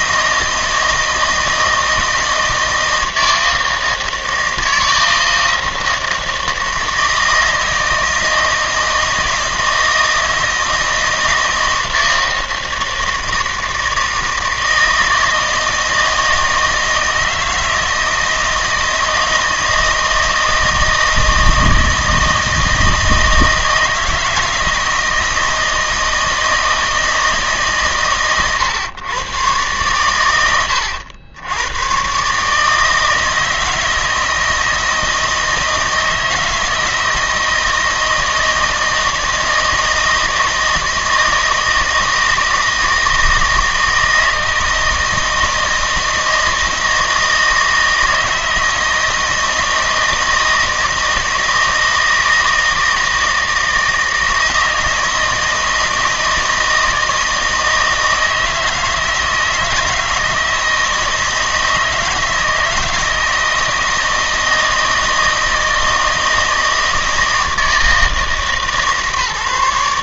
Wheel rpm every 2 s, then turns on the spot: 160, 160, 160, 160, 160, 160, 160, 160, 160, 160, 160, 160, 160, 160, 120, 90, 150, 160, 160, 160, 160, 160, 160, 160, 160, 160, 160, 160, 160, 160, 160, 160, 160, 160, 160.
none